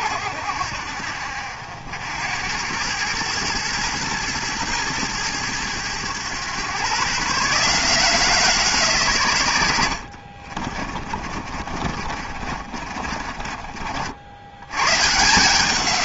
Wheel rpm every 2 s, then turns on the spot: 70, 90, 110, 120, 160, 40, 50, 110.
10-14